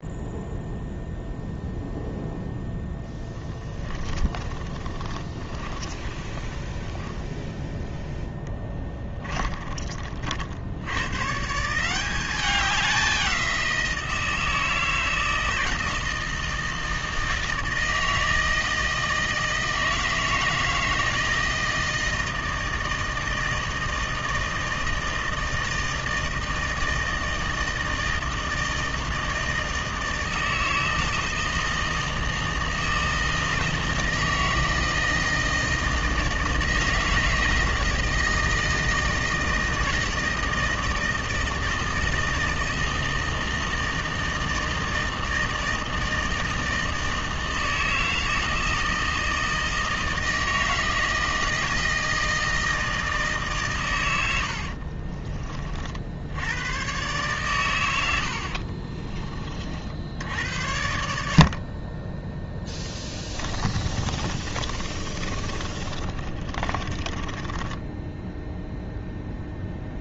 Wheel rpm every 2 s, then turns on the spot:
0, 10, 30, 10, 20, 120, 190, 160, 160, 160, 160, 160, 160, 160, 160, 160, 160, 160, 160, 160, 160, 160, 160, 160, 160, 160, 160, 40, 120, 30, 70, 10, 30, 30, 0.
2-10 54-56 62-68